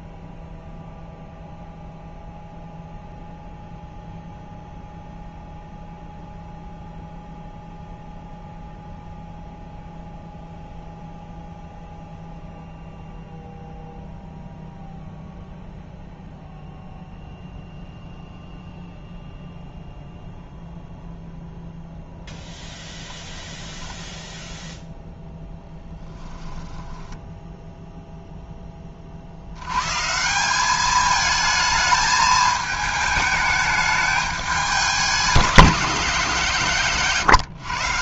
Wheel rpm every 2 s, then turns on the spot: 0, 0, 0, 0, 0, 0, 0, 0, 0, 0, 0, 0, 0, 10, 20, 200, 220, 200, 140.
26-28